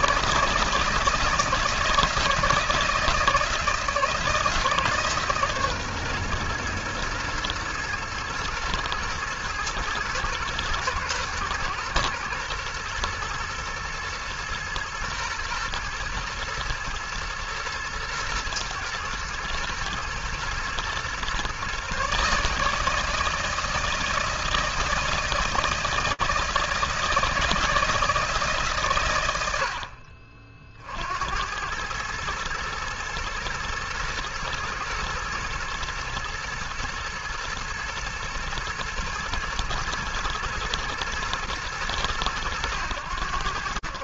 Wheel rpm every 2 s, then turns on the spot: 160, 160, 140, 120, 110, 110, 120, 110, 120, 110, 130, 160, 160, 160, 90, 80, 120, 110, 110, 120, 110, 90.
none